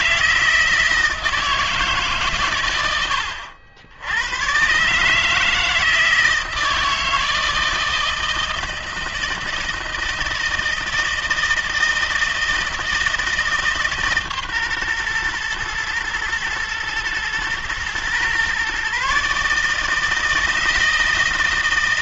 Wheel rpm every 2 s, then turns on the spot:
160, 130, 120, 160, 160, 160, 160, 140, 120, 130, 160.
none